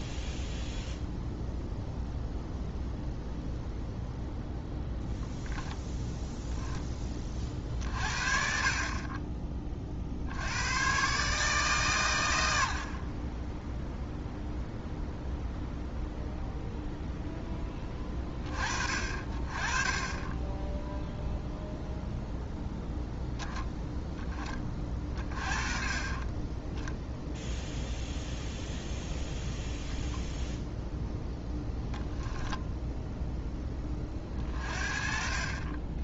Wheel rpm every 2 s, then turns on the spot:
0, 0, 0, 10, 40, 110, 50, 0, 0, 40, 0, 0, 30, 10, 0, 0, 0, 40.
none